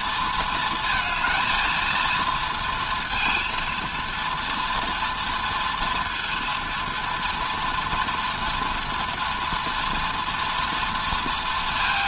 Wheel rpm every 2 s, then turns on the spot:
220, 230, 230, 230, 230, 240.
none